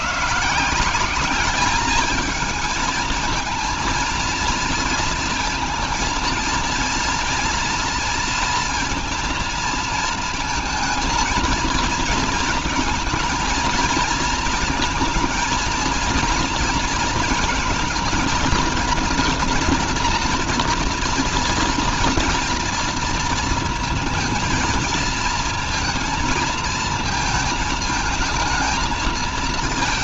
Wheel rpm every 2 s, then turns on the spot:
180, 220, 220, 230, 230, 220, 220, 230, 230, 230, 240, 230, 230, 220, 220.
none